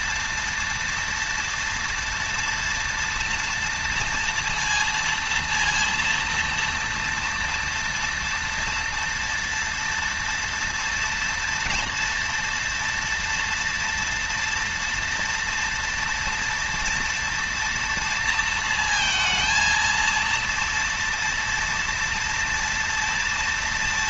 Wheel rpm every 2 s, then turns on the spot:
230, 230, 230, 230, 230, 230, 230, 240, 230, 230, 230, 230.
none